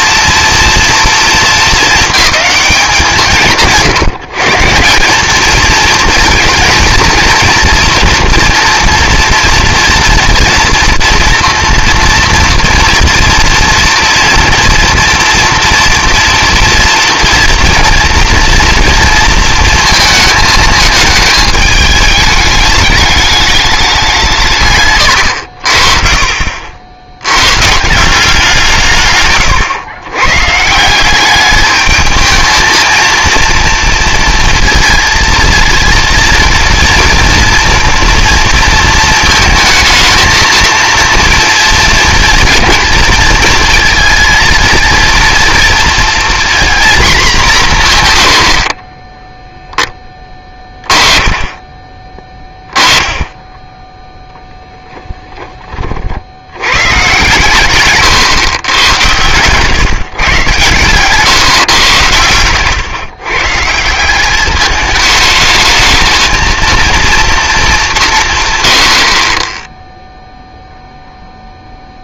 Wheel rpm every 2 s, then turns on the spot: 230, 180, 180, 220, 230, 230, 230, 230, 230, 230, 220, 210, 150, 50, 160, 150, 230, 230, 230, 230, 230, 230, 230, 240, 70, 20, 20, 10, 110, 120, 130, 120, 210, 230, 130, 0.
58-60